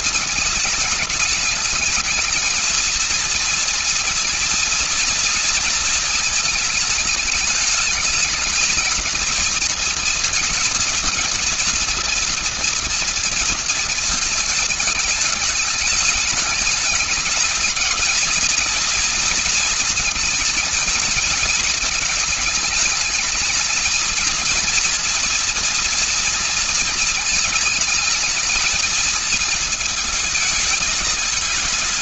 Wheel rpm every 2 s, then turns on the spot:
210, 230, 230, 220, 230, 230, 230, 210, 220, 230, 220, 220, 230, 220, 220, 210.
none